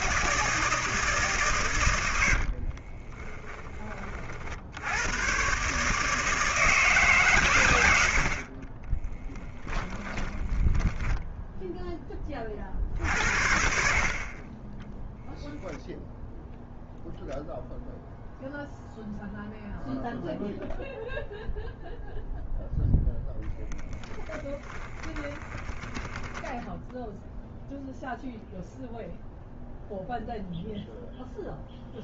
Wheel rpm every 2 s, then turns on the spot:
160, 30, 100, 140, 20, 10, 50, 10, 0, 0, 0, 0, 20, 0, 0, 0.
2-4 8-12 24-26